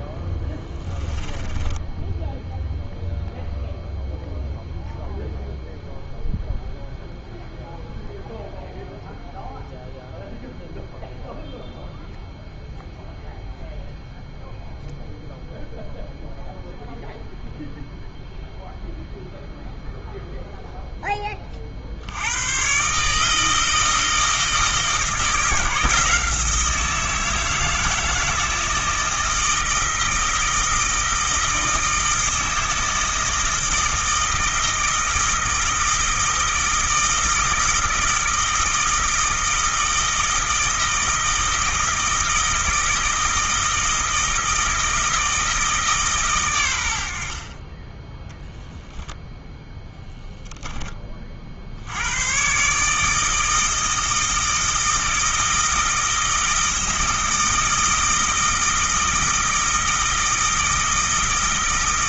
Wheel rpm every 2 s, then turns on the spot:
10, 0, 0, 0, 0, 0, 0, 0, 0, 0, 0, 140, 160, 160, 160, 160, 160, 160, 160, 160, 160, 160, 160, 100, 0, 20, 150, 160, 160, 160, 160.
0-2